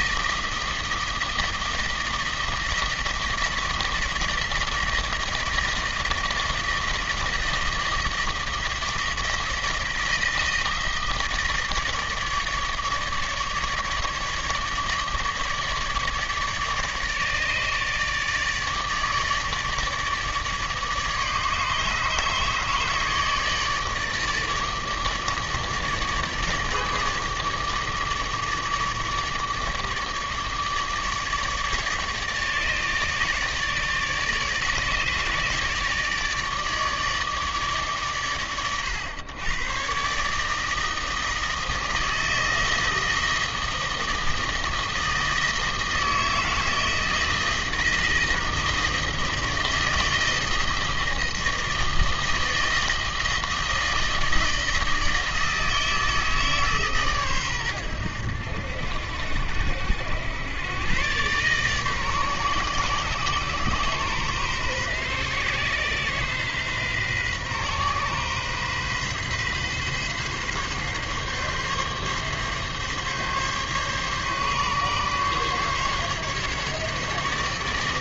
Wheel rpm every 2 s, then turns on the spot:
160, 160, 160, 160, 160, 160, 150, 150, 150, 150, 150, 150, 150, 150, 150, 150, 150, 150, 150, 110, 150, 160, 160, 160, 160, 160, 160, 160, 150, 80, 100, 130, 130, 130, 130, 140, 140, 140, 140.
none